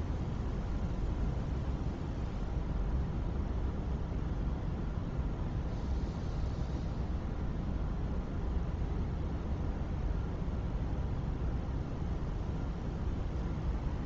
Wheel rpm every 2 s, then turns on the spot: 0, 0, 0, 0, 0, 0, 0.
none